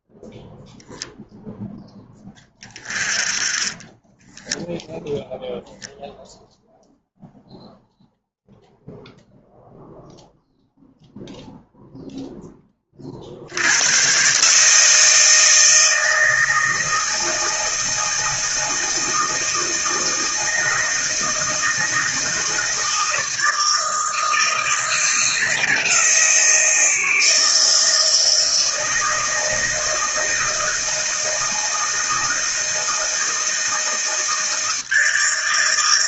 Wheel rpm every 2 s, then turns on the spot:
0, 20, 0, 0, 0, 0, 30, 160, 160, 160, 160, 160, 160, 160, 160, 160, 160, 160.
none